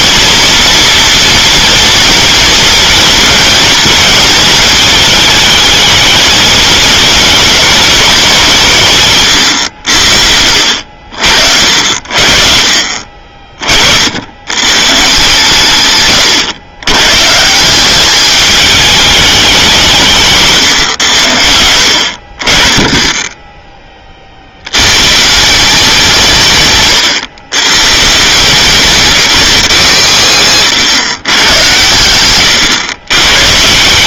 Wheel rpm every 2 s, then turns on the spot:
240, 230, 220, 220, 140, 70, 50, 140, 120, 220, 120, 20, 120, 130, 170, 90, 120.
22-24 30-32